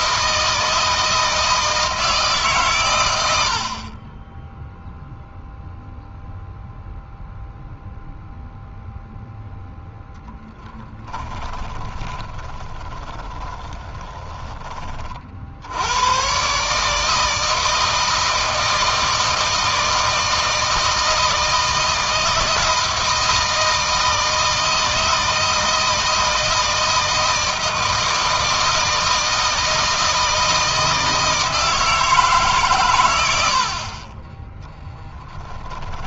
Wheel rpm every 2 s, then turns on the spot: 160, 120, 0, 0, 0, 10, 20, 30, 140, 160, 160, 160, 160, 160, 160, 160, 120, 10.
10-14 34-36